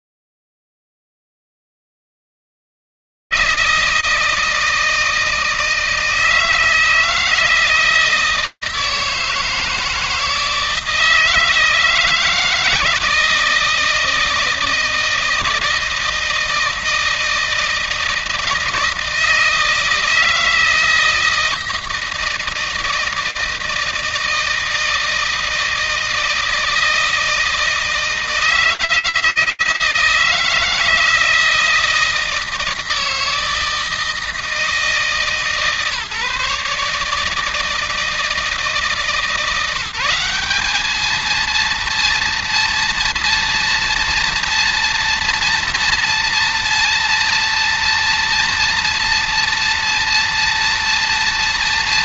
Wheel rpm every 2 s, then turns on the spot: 30, 140, 160, 160, 160, 160, 160, 160, 160, 160, 160, 160, 160, 160, 160, 160, 160, 160, 150, 150, 210, 230, 230, 230, 230, 230.
none